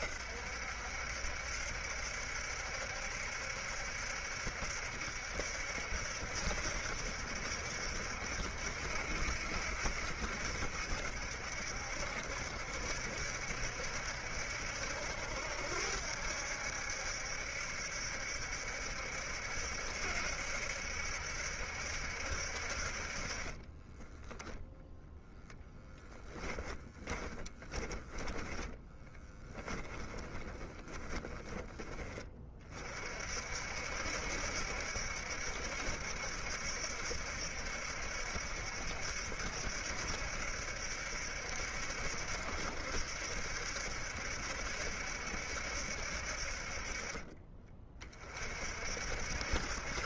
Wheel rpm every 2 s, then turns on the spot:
70, 70, 70, 70, 70, 70, 70, 70, 70, 70, 70, 60, 0, 10, 20, 20, 40, 70, 70, 70, 70, 70, 70, 50, 40.
26-32